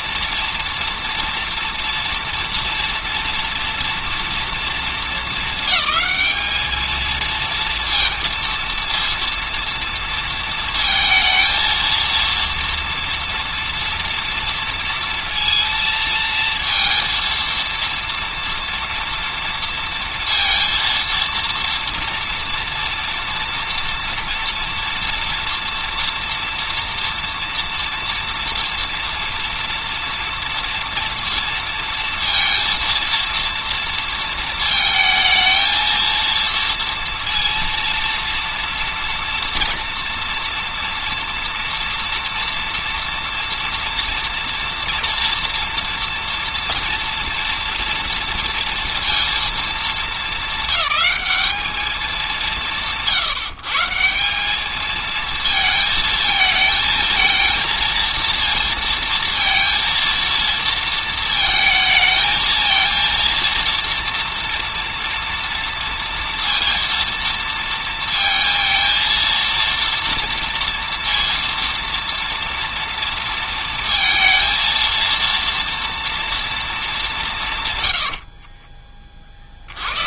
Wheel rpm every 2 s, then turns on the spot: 230, 230, 220, 220, 230, 220, 230, 230, 230, 230, 230, 230, 230, 230, 230, 230, 230, 220, 230, 230, 230, 230, 230, 230, 230, 210, 170, 220, 220, 230, 230, 230, 230, 230, 230, 230, 230, 230, 220, 20.
none